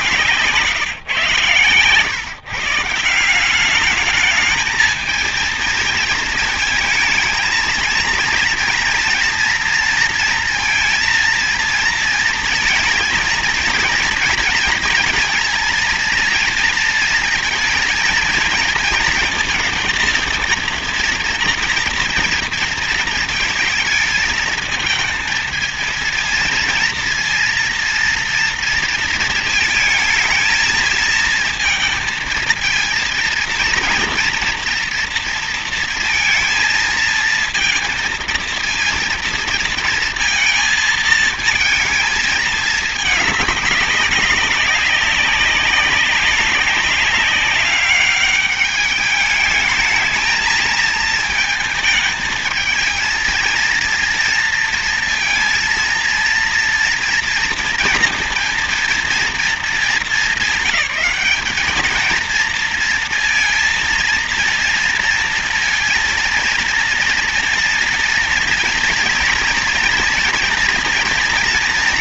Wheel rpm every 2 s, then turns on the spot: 120, 200, 230, 230, 230, 230, 230, 230, 230, 230, 230, 220, 230, 240, 220, 220, 230, 230, 220, 230, 220, 210, 190, 200, 220, 220, 230, 230, 230, 220, 210, 230, 230, 230, 230, 230.
none